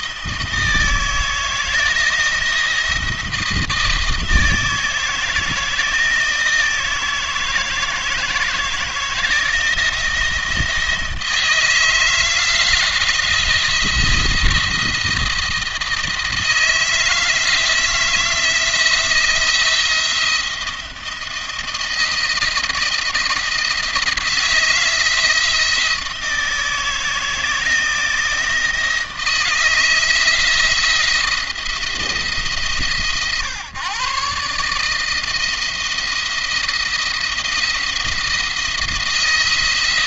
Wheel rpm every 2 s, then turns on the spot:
160, 170, 160, 160, 170, 160, 170, 170, 160, 170, 170, 170, 170, 160, 160, 170, 150, 150, 160, 170.
none